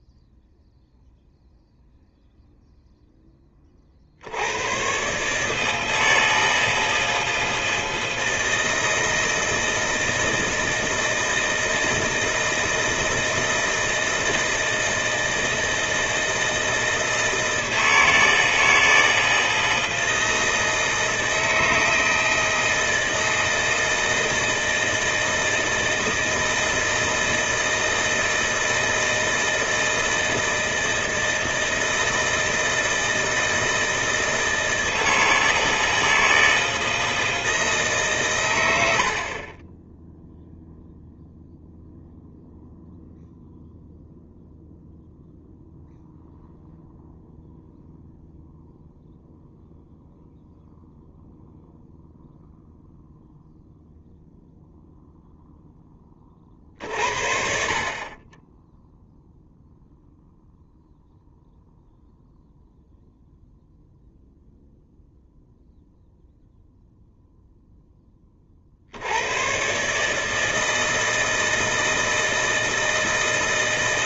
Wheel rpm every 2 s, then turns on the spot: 0, 0, 90, 160, 160, 160, 160, 160, 160, 160, 160, 160, 160, 160, 160, 160, 160, 160, 160, 120, 0, 0, 0, 0, 0, 0, 0, 0, 40, 10, 0, 0, 0, 0, 40, 160, 160.
none